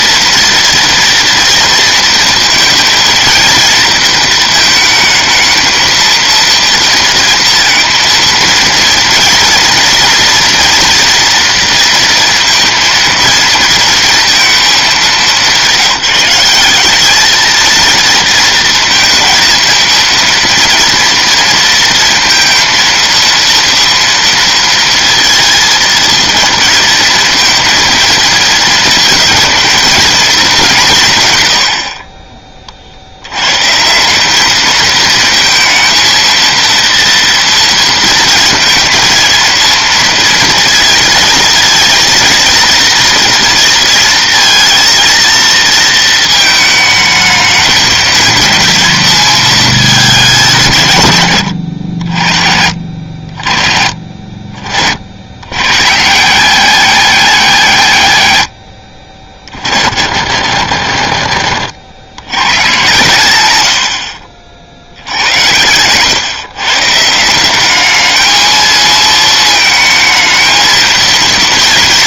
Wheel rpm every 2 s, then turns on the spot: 230, 230, 220, 230, 230, 230, 230, 220, 200, 230, 230, 230, 230, 230, 220, 190, 50, 220, 230, 230, 220, 230, 230, 220, 220, 170, 60, 50, 210, 90, 70, 120, 70, 140, 220, 230.
none